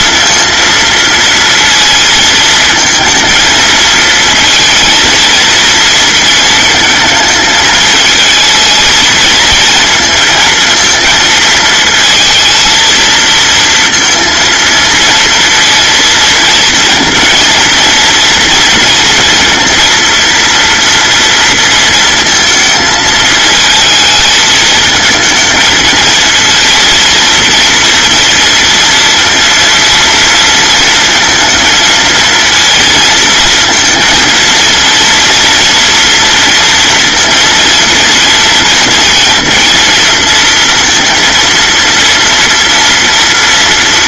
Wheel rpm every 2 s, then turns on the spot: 230, 230, 230, 230, 220, 220, 230, 230, 230, 230, 240, 220, 220, 230, 230, 230, 230, 230, 230, 230, 230, 230.
none